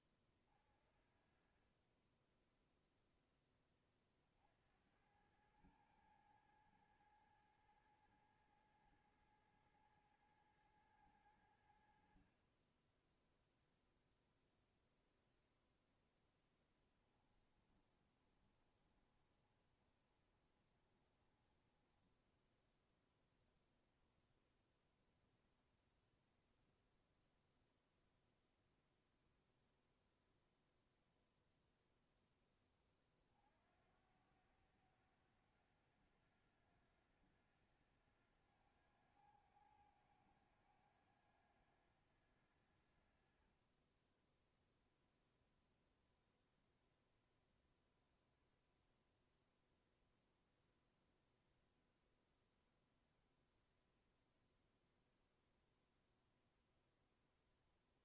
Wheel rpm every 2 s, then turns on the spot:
40, 20, 50, 110, 110, 110, 50, 0, 0, 20, 20, 10, 10, 0, 0, 0, 10, 80, 90, 90, 90, 80, 10, 0, 0, 0, 0, 0, 0.
18-24